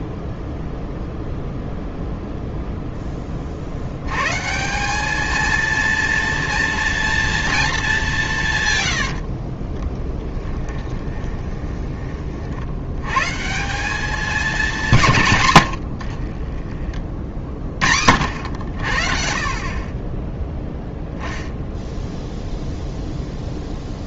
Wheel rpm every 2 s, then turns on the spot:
0, 0, 180, 230, 130, 20, 70, 190, 30, 60, 0, 0.
10-12